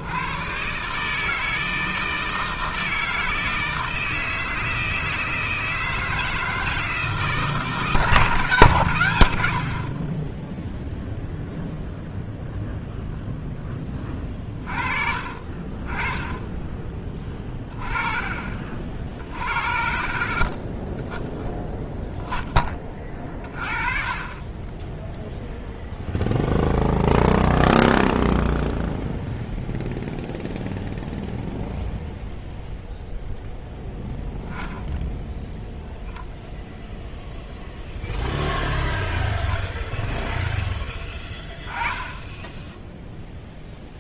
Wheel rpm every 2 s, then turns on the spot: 140, 160, 160, 160, 120, 0, 0, 30, 20, 50, 20, 20, 20, 0, 0, 0, 0, 10, 10, 0, 10, 10.
none